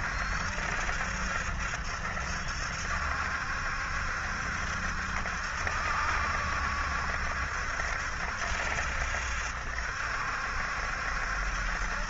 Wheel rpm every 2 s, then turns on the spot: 70, 70, 70, 70, 70, 70.
none